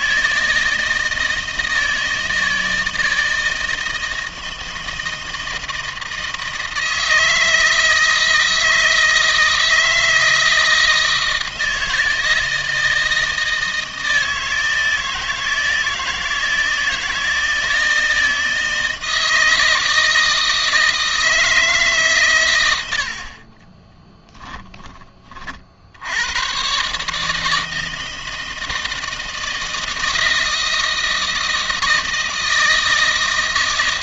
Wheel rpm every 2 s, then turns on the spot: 160, 160, 160, 160, 160, 160, 160, 160, 160, 160, 160, 100, 10, 110, 160, 160, 160.
22-24